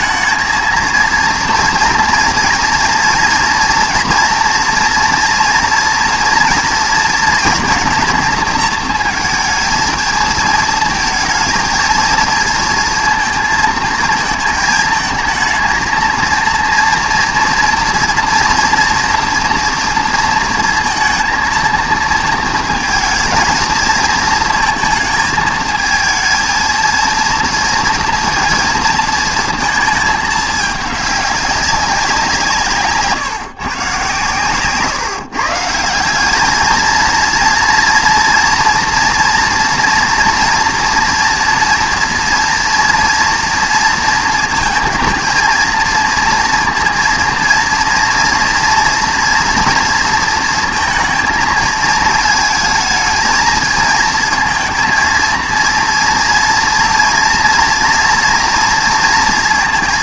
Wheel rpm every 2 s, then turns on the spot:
230, 240, 230, 230, 230, 230, 230, 220, 230, 230, 230, 220, 220, 230, 230, 210, 160, 140, 220, 240, 240, 230, 230, 230, 230, 230, 220, 230, 230, 230.
34-36